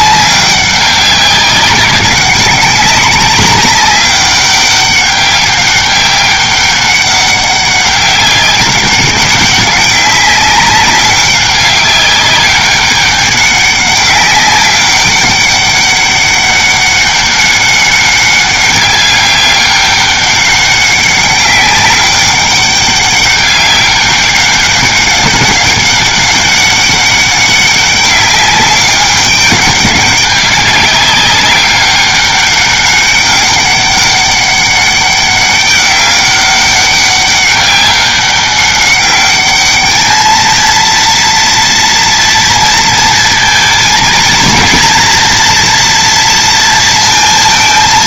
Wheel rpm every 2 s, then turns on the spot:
190, 190, 200, 190, 190, 190, 200, 190, 200, 200, 200, 200, 200, 200, 200, 200, 200, 200, 200, 200, 230, 230, 220, 230.
none